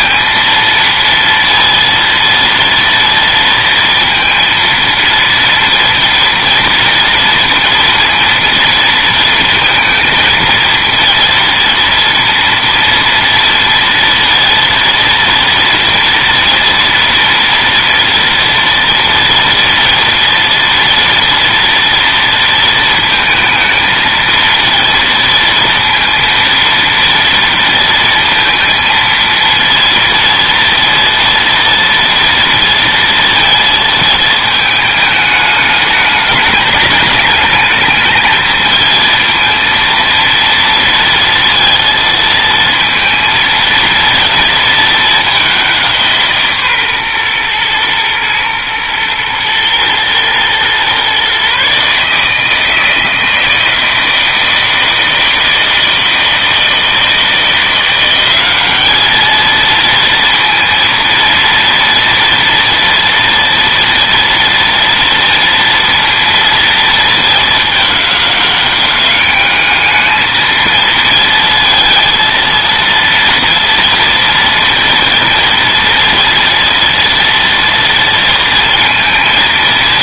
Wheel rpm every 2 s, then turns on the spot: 230, 230, 230, 230, 230, 230, 230, 230, 230, 230, 230, 230, 230, 230, 230, 230, 230, 220, 220, 220, 230, 230, 230, 140, 120, 120, 160, 160, 160, 200, 230, 230, 230, 230, 200, 220, 230, 230, 230, 230.
none